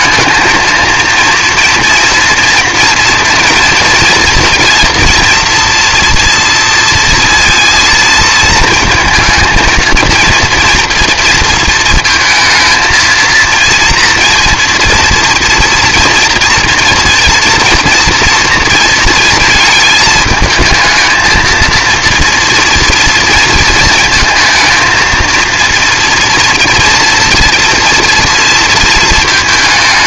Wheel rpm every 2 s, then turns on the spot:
230, 230, 230, 230, 220, 230, 230, 230, 230, 230, 220, 230, 230, 230, 220.
none